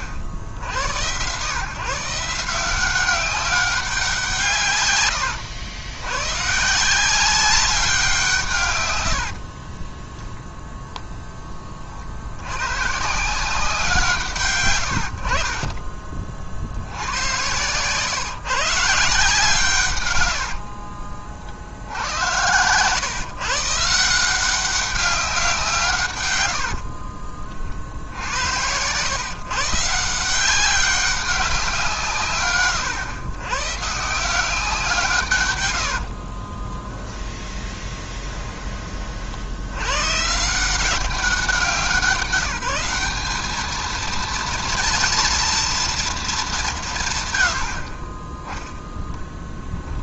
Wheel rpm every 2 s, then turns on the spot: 80, 180, 130, 160, 130, 0, 120, 100, 70, 150, 70, 110, 190, 80, 100, 190, 120, 170, 20, 20, 160, 180, 230, 180, 0.
20-22 26-28 36-38